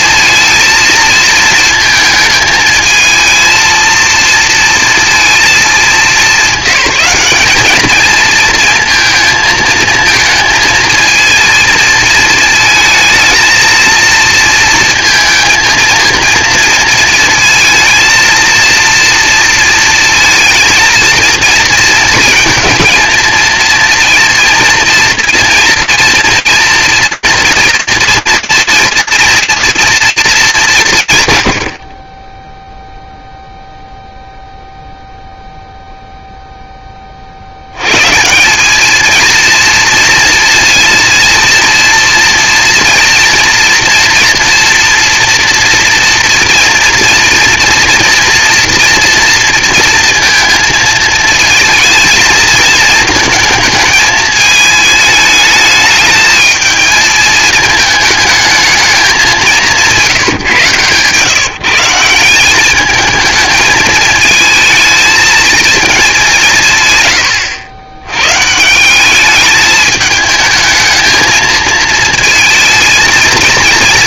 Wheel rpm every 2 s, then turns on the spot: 230, 220, 230, 190, 230, 230, 220, 230, 230, 230, 230, 220, 230, 240, 230, 200, 0, 0, 30, 220, 230, 230, 230, 230, 230, 220, 220, 220, 220, 210, 130, 210, 220, 130, 190, 220, 230.
none